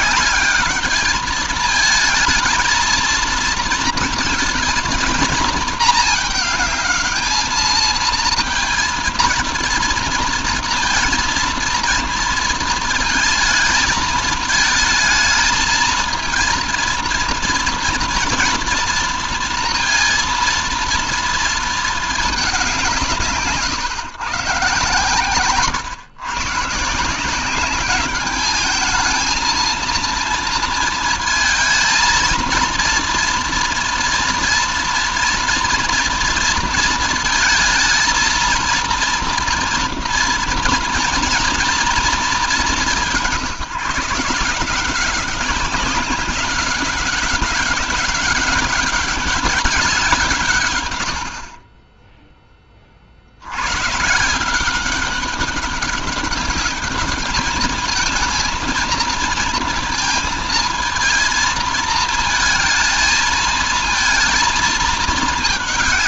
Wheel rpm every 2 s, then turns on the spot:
200, 220, 220, 220, 220, 230, 230, 220, 230, 240, 230, 210, 140, 120, 200, 230, 230, 240, 230, 220, 230, 220, 170, 190, 200, 170, 10, 140, 200, 220, 220, 220, 230.
none